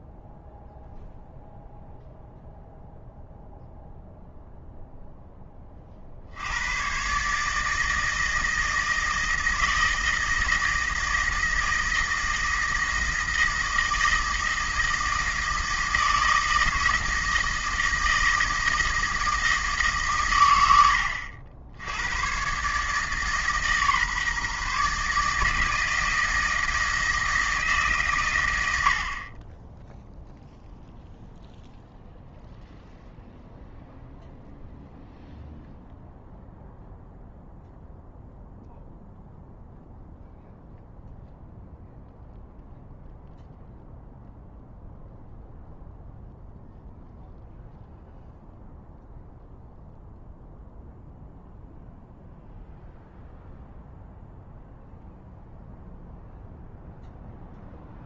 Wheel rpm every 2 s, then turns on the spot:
0, 0, 0, 100, 160, 160, 160, 160, 160, 160, 100, 140, 150, 160, 80, 0, 0, 0, 0, 0, 0, 0, 0, 0, 0, 0, 0, 0, 0.
none